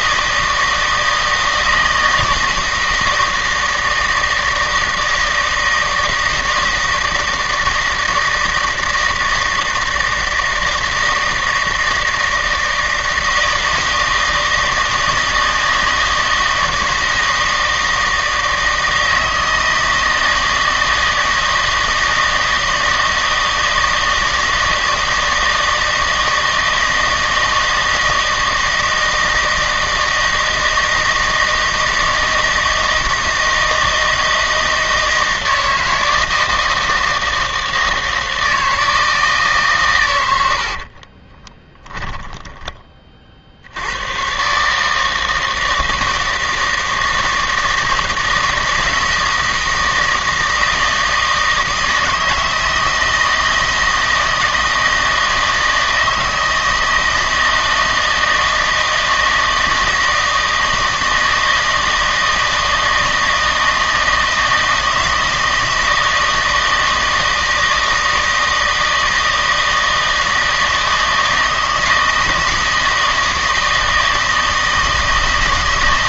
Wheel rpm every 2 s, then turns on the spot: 160, 160, 160, 160, 160, 160, 160, 160, 160, 160, 160, 160, 160, 160, 160, 160, 160, 160, 160, 160, 60, 10, 150, 160, 160, 160, 160, 160, 160, 160, 160, 160, 160, 160, 160, 160, 160, 160.
40-42